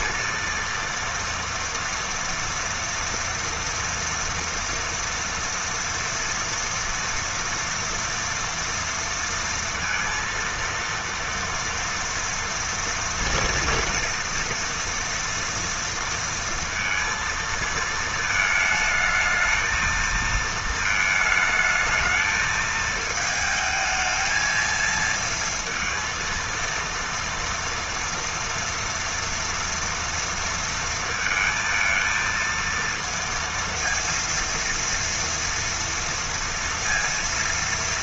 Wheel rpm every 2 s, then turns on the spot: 230, 230, 230, 230, 230, 230, 230, 230, 230, 220, 220, 220, 230, 230, 230, 230, 230, 230, 230.
none